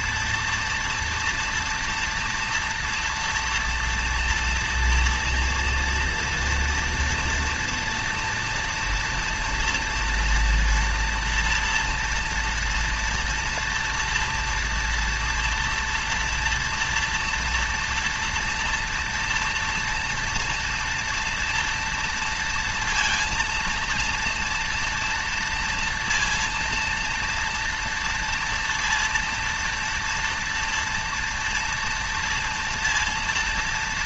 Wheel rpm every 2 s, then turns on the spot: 230, 230, 230, 230, 240, 230, 230, 230, 230, 230, 230, 230, 230, 230, 230, 230, 230.
none